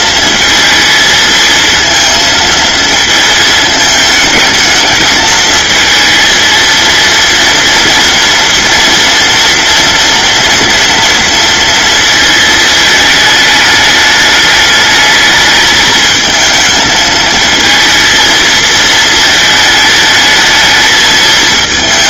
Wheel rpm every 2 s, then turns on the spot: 230, 220, 220, 230, 240, 230, 220, 220, 220, 220, 220.
none